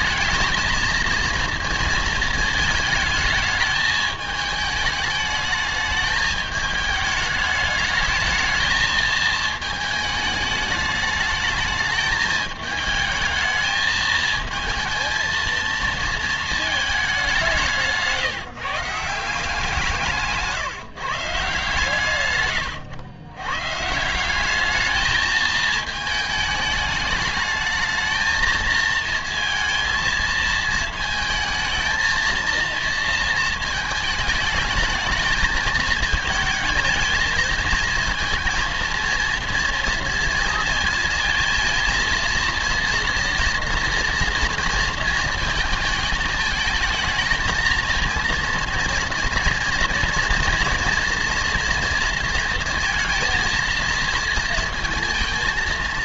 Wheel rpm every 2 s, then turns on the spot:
220, 220, 210, 220, 220, 210, 220, 230, 220, 150, 160, 110, 210, 210, 220, 220, 230, 210, 220, 230, 230, 230, 230, 220, 230, 230, 230, 230.
none